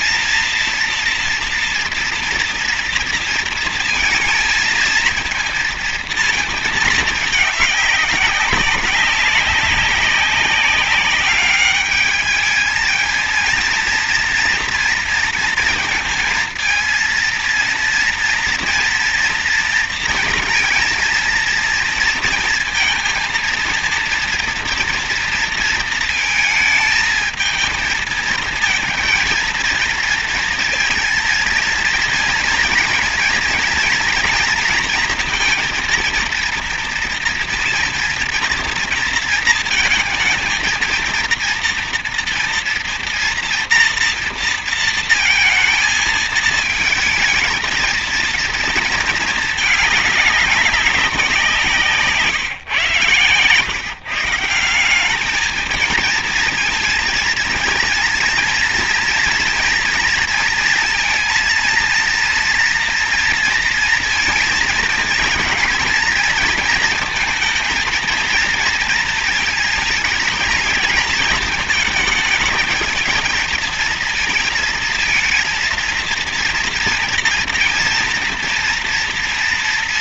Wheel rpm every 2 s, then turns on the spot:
240, 230, 230, 220, 190, 200, 220, 230, 230, 230, 230, 230, 230, 220, 230, 230, 230, 230, 230, 230, 230, 230, 230, 220, 230, 200, 130, 190, 230, 230, 230, 230, 220, 230, 220, 220, 220, 230, 230, 230.
none